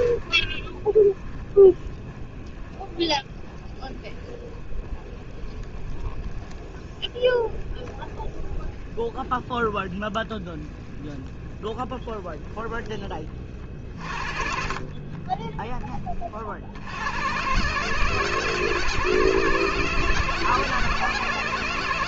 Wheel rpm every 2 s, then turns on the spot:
30, 20, 20, 20, 20, 20, 10, 30, 70, 130, 130.
none